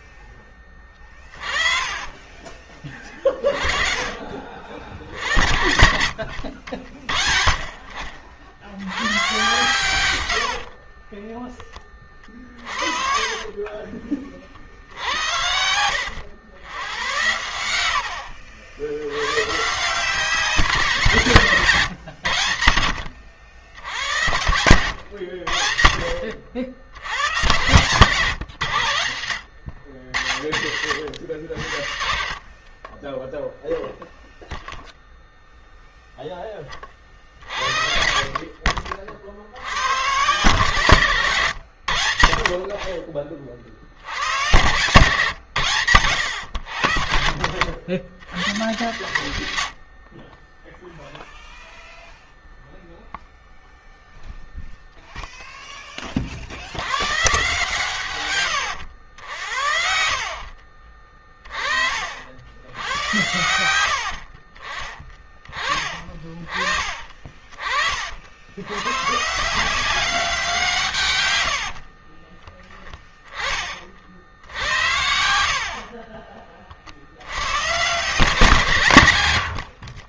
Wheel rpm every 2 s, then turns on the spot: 20, 20, 50, 60, 90, 30, 40, 70, 100, 100, 160, 80, 110, 100, 120, 100, 20, 0, 30, 50, 120, 50, 120, 70, 130, 10, 0, 0, 120, 90, 40, 100, 30, 40, 130, 140, 10, 80, 70, 130.
10-16